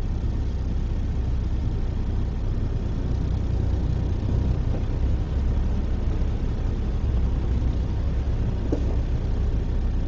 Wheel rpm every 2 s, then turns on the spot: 0, 0, 0, 0, 0.
none